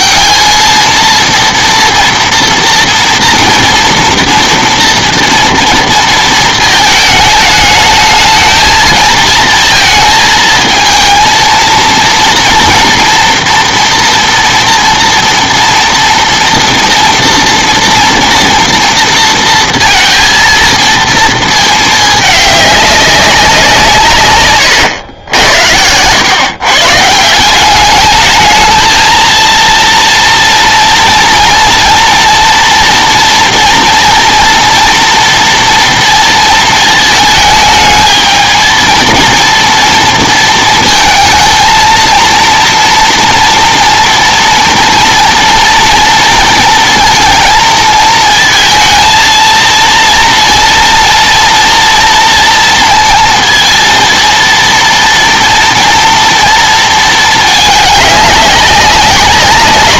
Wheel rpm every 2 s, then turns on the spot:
230, 230, 240, 220, 220, 220, 230, 230, 230, 230, 230, 210, 120, 120, 220, 230, 230, 230, 220, 220, 230, 230, 230, 230, 230, 230, 230, 230, 230, 200.
24-26